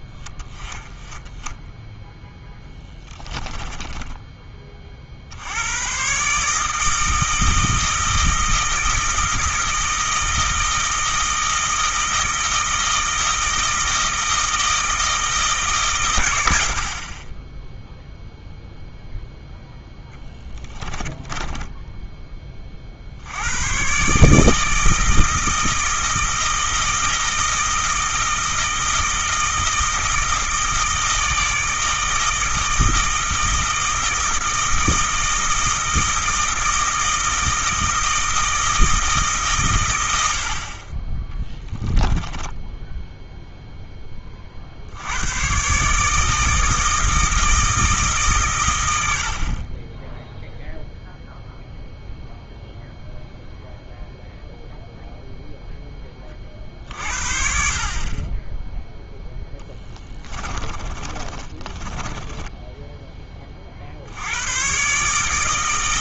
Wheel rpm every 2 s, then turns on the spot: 10, 10, 40, 160, 170, 160, 160, 160, 60, 0, 20, 60, 160, 160, 160, 160, 160, 160, 160, 160, 30, 10, 70, 160, 100, 0, 0, 0, 50, 10, 30, 10, 130.
2-4 20-22 60-62